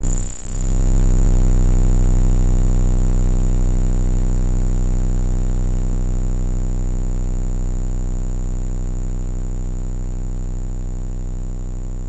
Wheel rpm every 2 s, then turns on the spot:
0, 0, 80, 60, 20, 20.
6-10